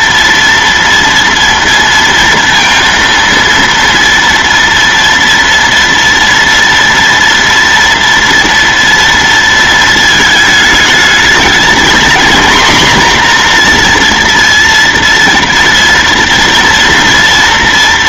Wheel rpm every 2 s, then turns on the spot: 230, 230, 230, 230, 230, 220, 250, 230, 240.
none